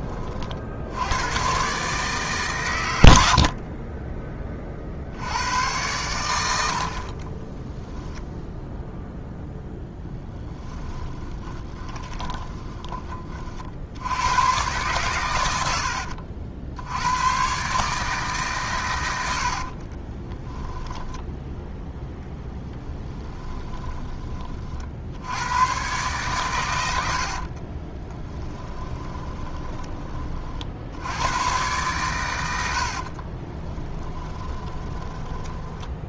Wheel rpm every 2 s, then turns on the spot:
70, 110, 40, 70, 0, 10, 20, 130, 70, 130, 10, 10, 40, 100, 10, 60, 80, 20.
10-12 20-24 28-30 32-36